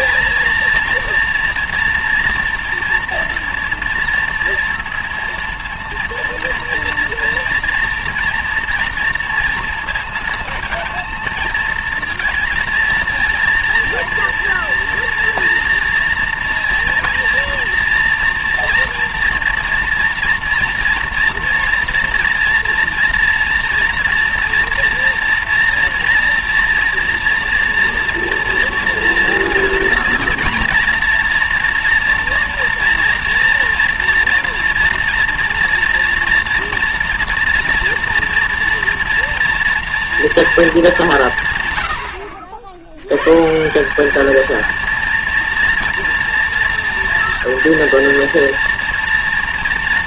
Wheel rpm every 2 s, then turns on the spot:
230, 240, 230, 230, 230, 230, 230, 230, 230, 230, 230, 230, 230, 230, 230, 230, 230, 230, 230, 230, 230, 70, 230, 230, 230.
none